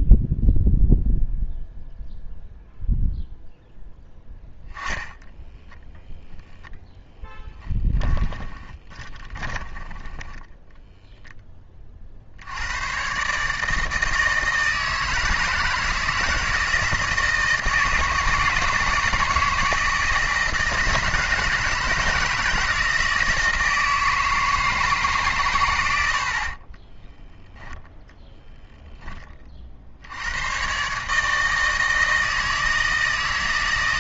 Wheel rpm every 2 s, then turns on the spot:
0, 0, 10, 0, 20, 10, 80, 160, 160, 160, 160, 160, 160, 20, 0, 110, 160.
4-6 8-12 26-28